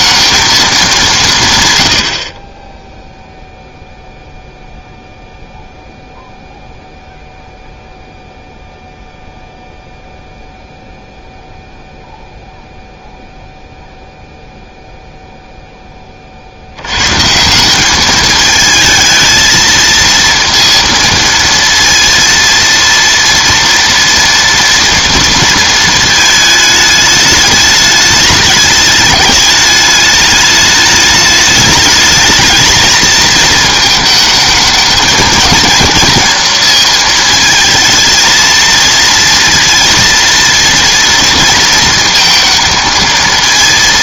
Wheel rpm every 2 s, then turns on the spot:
210, 10, 0, 0, 0, 0, 0, 0, 80, 220, 230, 230, 240, 220, 210, 210, 220, 220, 230, 230, 230, 220.
none